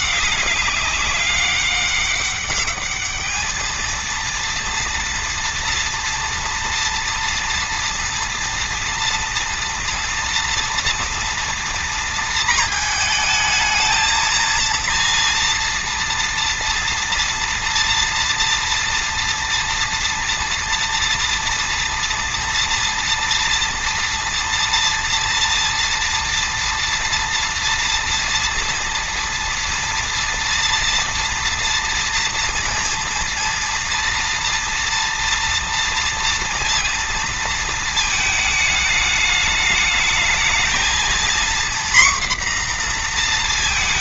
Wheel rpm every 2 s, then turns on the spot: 200, 210, 230, 230, 230, 230, 220, 230, 230, 230, 230, 230, 230, 230, 230, 230, 230, 240, 230, 210, 230, 240.
none